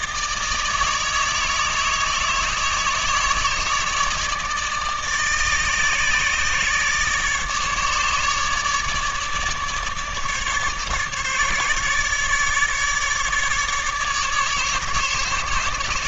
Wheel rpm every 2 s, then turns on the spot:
160, 150, 160, 150, 150, 150, 150, 150.
none